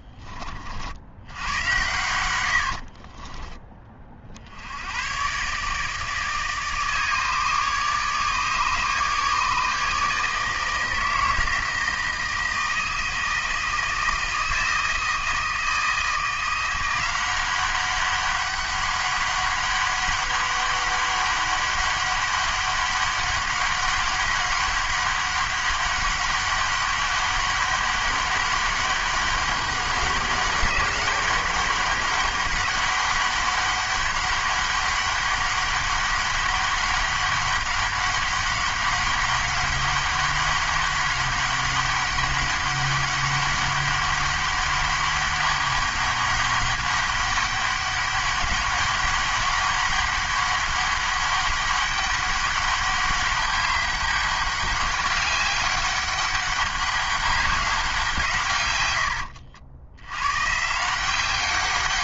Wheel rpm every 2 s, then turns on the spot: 50, 80, 70, 150, 150, 160, 160, 160, 170, 200, 200, 200, 200, 200, 200, 200, 200, 200, 200, 200, 200, 200, 200, 200, 200, 200, 200, 200, 200, 120, 150.
2-4